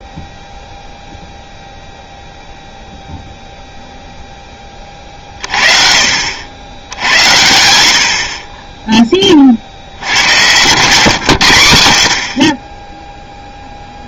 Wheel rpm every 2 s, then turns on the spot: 0, 0, 20, 80, 20, 120, 20.
none